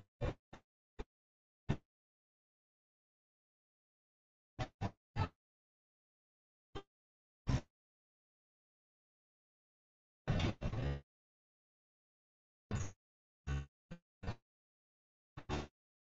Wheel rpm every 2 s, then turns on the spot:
0, 0, 0, 0, 0, 0, 0, 0.
none